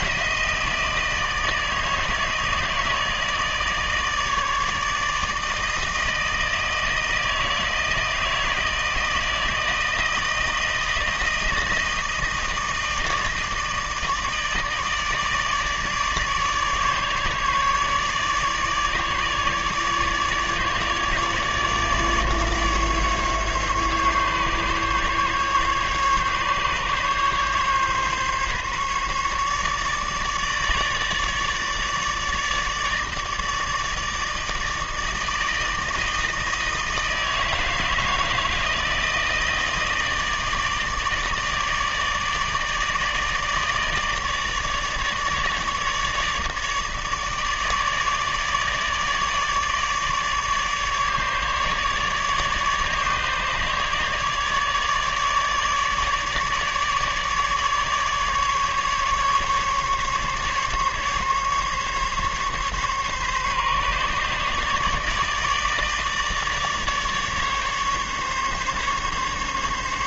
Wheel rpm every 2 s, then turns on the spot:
160, 160, 150, 160, 160, 160, 160, 150, 150, 150, 150, 140, 140, 140, 150, 160, 160, 160, 160, 160, 150, 160, 150, 150, 150, 150, 150, 150, 150, 150, 140, 140, 150, 150, 140.
none